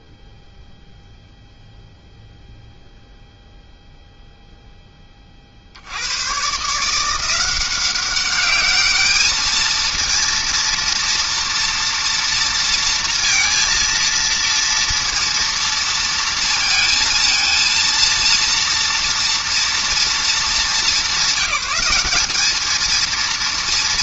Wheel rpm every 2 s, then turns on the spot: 0, 0, 0, 120, 200, 230, 230, 230, 230, 230, 220, 210.
none